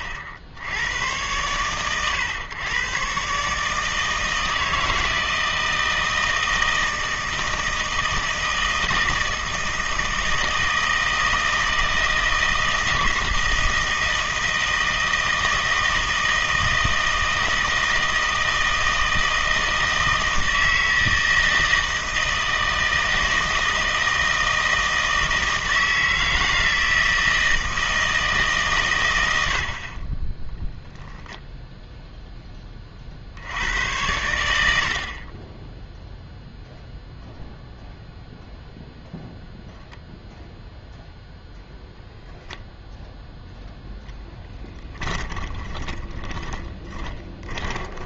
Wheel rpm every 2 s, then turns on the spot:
70, 120, 160, 160, 160, 160, 160, 160, 160, 160, 160, 160, 160, 160, 130, 0, 30, 70, 0, 0, 0, 0, 10, 30.
44-48